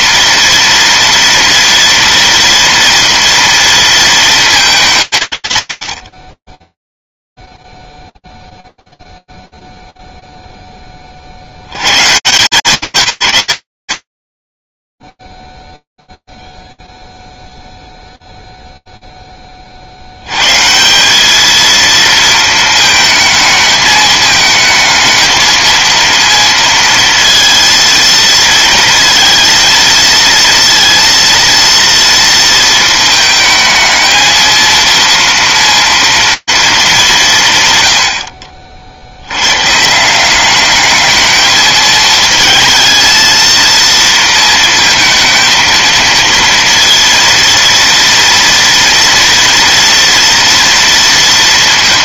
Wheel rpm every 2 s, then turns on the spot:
230, 230, 210, 20, 0, 0, 140, 10, 0, 0, 140, 220, 220, 230, 230, 230, 230, 230, 230, 70, 200, 220, 230, 230, 240, 230.
none